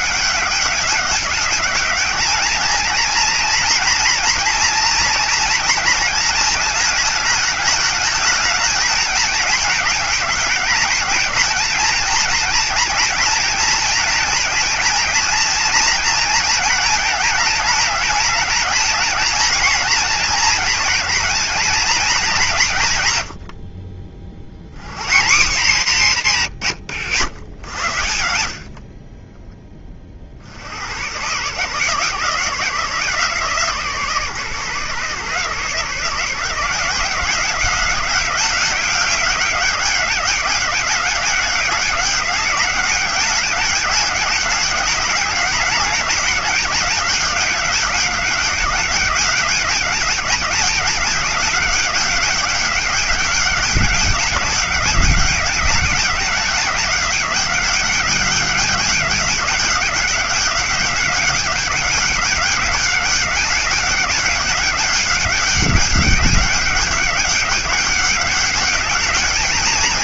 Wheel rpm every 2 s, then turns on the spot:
200, 220, 230, 220, 220, 210, 220, 230, 220, 220, 230, 150, 80, 160, 50, 100, 160, 140, 170, 190, 190, 200, 200, 190, 200, 200, 190, 200, 190, 200, 200, 200, 200, 190, 200.
none